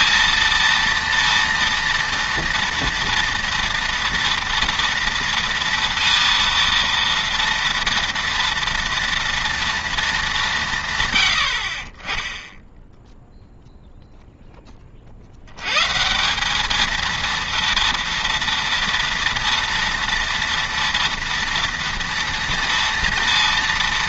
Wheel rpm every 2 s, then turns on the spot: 230, 230, 230, 230, 230, 160, 10, 20, 210, 230, 230, 230.
none